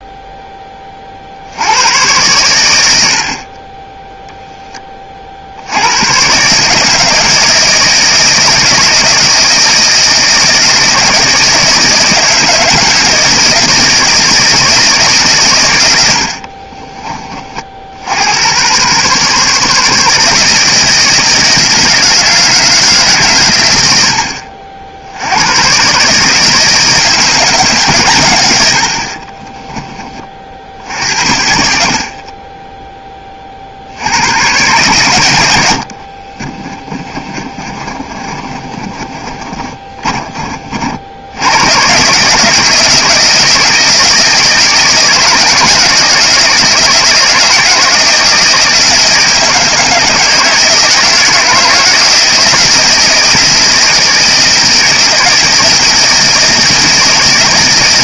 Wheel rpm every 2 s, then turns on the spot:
20, 100, 10, 150, 160, 160, 160, 160, 40, 110, 160, 160, 80, 150, 100, 50, 20, 110, 30, 30, 40, 160, 160, 160, 160, 160, 160, 160, 160.
16-18 32-34 36-40